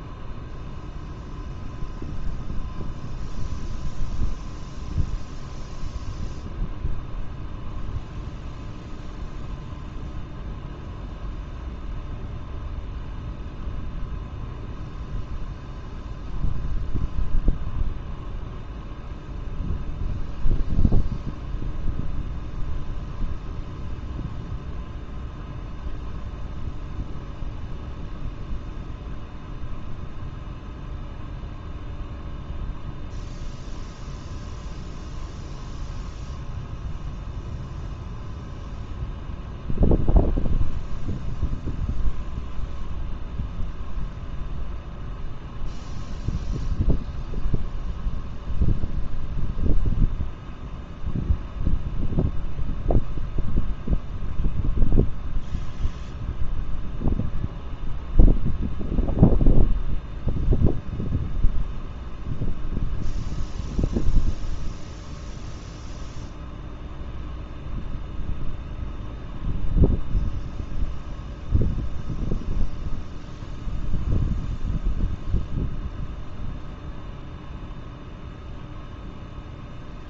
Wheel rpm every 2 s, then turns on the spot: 0, 0, 0, 0, 0, 0, 0, 0, 0, 0, 0, 0, 0, 0, 0, 0, 0, 0, 0, 0, 0, 0, 0, 0, 0, 0, 0, 0, 0, 0, 0, 0, 0, 0, 0, 0, 0, 0, 0, 0.
none